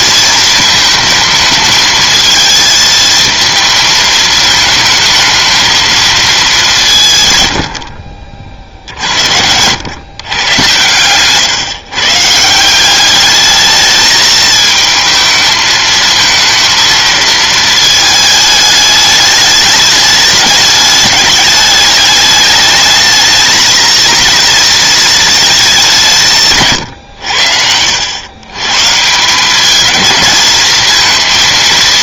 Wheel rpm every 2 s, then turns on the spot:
220, 220, 220, 170, 60, 110, 190, 220, 220, 210, 210, 220, 220, 120, 140, 220.
none